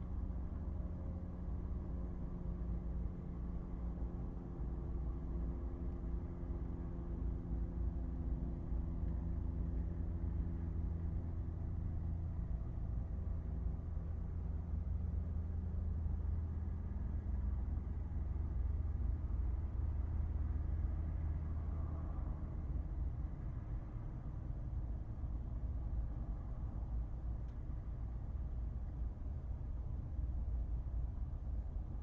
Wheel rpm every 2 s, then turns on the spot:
0, 0, 0, 0, 0, 0, 0, 0, 0, 0, 0, 0, 0, 0, 0, 0.
none